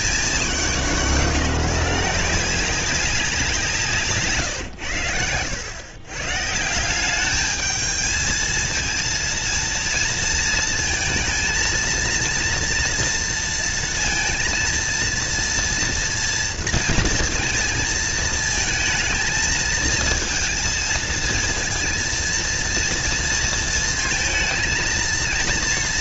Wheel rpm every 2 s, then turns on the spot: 180, 190, 110, 170, 230, 230, 230, 230, 230, 230, 230, 230, 230.
none